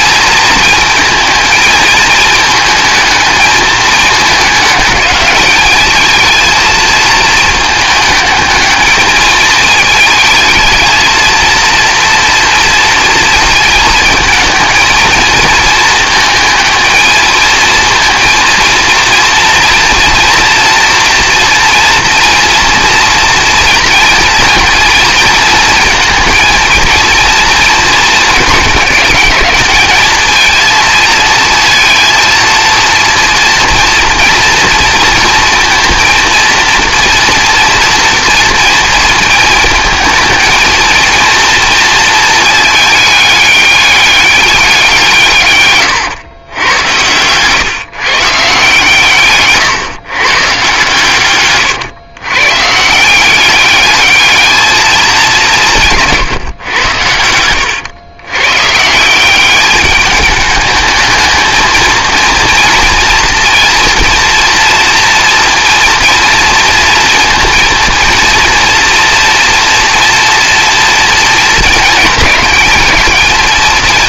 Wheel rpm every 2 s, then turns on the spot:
220, 220, 210, 230, 220, 230, 230, 230, 220, 230, 230, 230, 230, 220, 210, 230, 230, 230, 240, 230, 230, 220, 190, 100, 140, 140, 150, 210, 110, 150, 220, 230, 230, 230, 240, 230, 220.
none